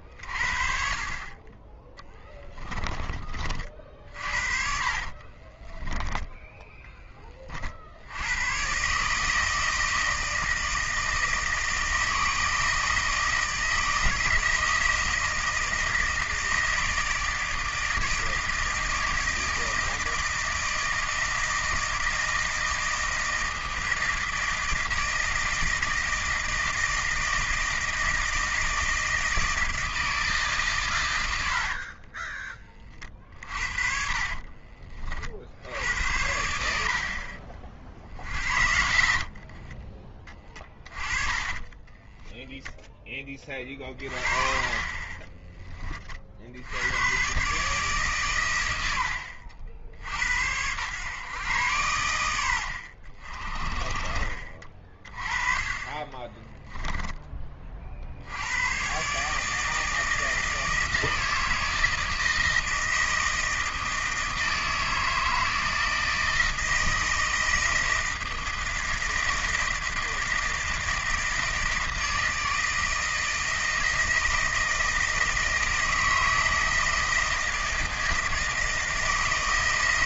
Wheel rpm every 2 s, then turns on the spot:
40, 10, 50, 10, 120, 160, 160, 160, 160, 160, 160, 160, 160, 160, 160, 140, 20, 40, 70, 60, 20, 0, 30, 70, 110, 100, 80, 40, 10, 100, 160, 160, 160, 160, 160, 160, 160, 160, 160, 160.
4-6 34-36 38-42 56-58